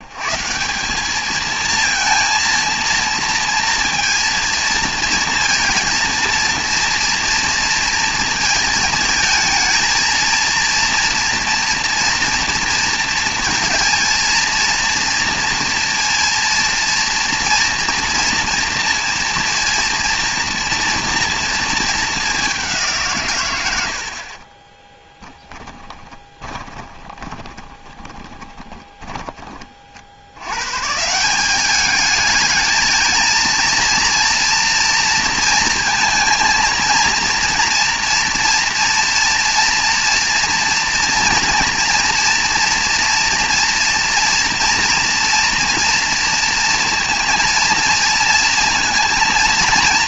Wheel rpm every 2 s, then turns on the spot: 170, 230, 230, 230, 220, 230, 230, 230, 230, 230, 230, 180, 20, 20, 30, 130, 220, 230, 230, 230, 230, 230, 230, 230, 230.
24-30